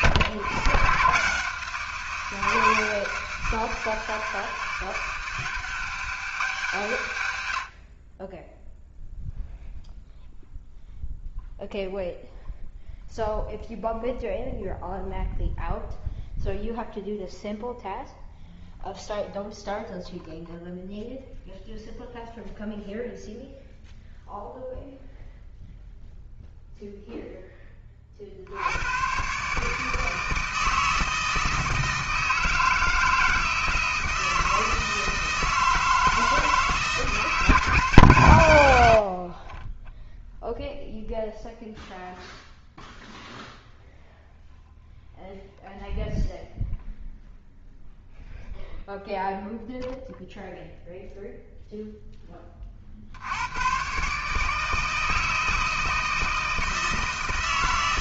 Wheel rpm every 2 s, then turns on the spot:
120, 170, 160, 170, 10, 0, 0, 0, 0, 0, 0, 0, 0, 0, 80, 160, 160, 160, 160, 110, 0, 0, 0, 0, 0, 0, 20, 150, 160.
none